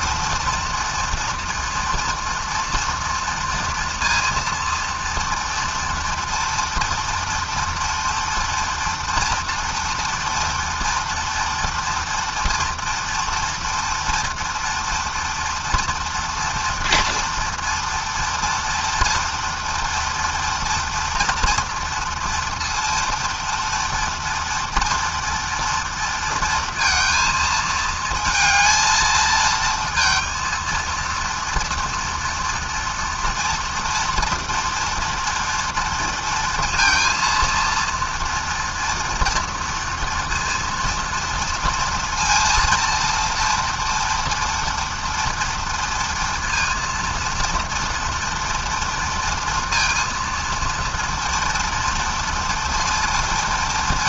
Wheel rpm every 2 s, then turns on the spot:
230, 230, 240, 230, 240, 230, 230, 230, 230, 240, 230, 230, 240, 230, 220, 230, 230, 230, 230, 230, 230, 230, 230, 230, 230, 230, 230.
none